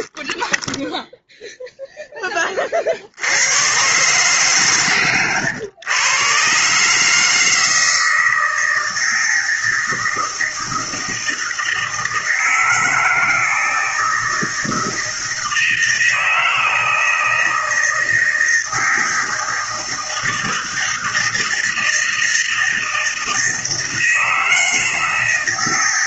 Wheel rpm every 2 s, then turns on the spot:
0, 20, 140, 130, 160, 160, 160, 160, 160, 170, 160, 160, 170.
none